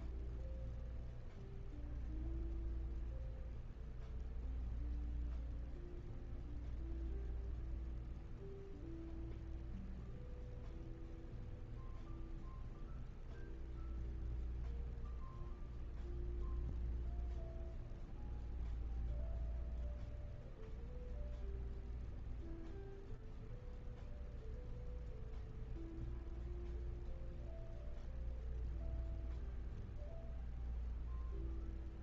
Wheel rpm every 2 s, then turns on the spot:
0, 0, 0, 0, 0, 0, 0, 0, 0, 0, 0, 0, 0, 0, 0, 0.
none